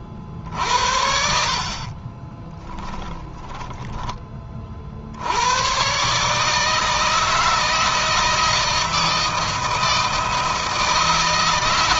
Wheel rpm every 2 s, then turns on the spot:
50, 10, 70, 160, 160, 160.
0-4